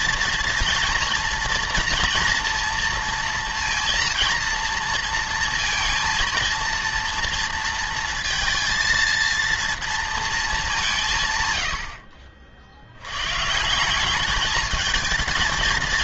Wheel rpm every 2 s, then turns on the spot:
230, 230, 230, 230, 230, 210, 60, 220.
none